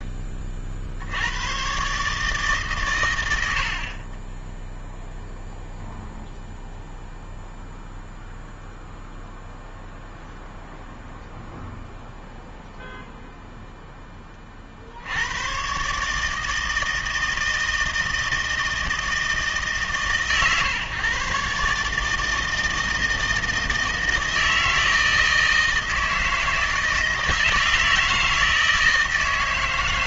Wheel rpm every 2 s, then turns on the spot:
60, 120, 0, 0, 0, 0, 0, 70, 160, 160, 130, 160, 160, 160, 160.
none